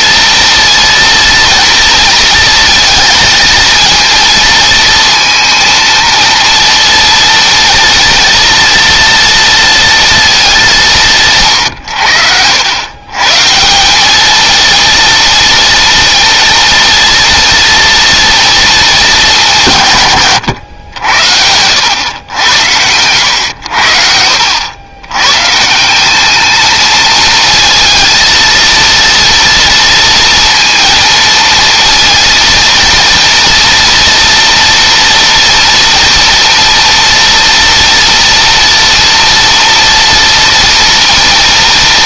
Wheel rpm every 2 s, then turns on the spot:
230, 220, 230, 230, 230, 180, 120, 230, 230, 220, 90, 90, 100, 220, 230, 230, 230, 230, 230, 230, 240.
22-24